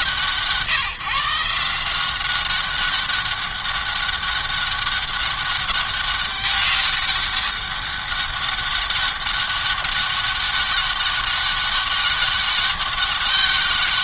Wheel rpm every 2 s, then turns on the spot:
160, 190, 200, 200, 200, 200, 200.
none